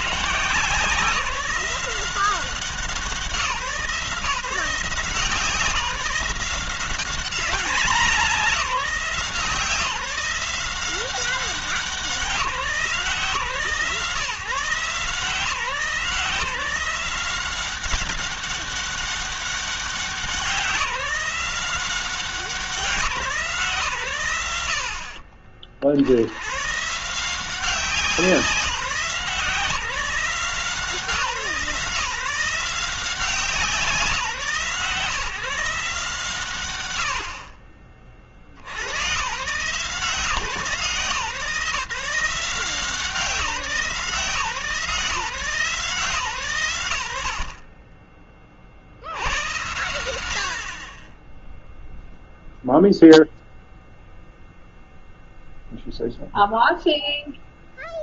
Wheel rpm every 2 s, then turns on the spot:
160, 180, 170, 190, 180, 180, 160, 140, 170, 200, 180, 170, 60, 160, 170, 170, 170, 160, 90, 120, 160, 170, 160, 80, 80, 20, 0, 0, 0.
24-26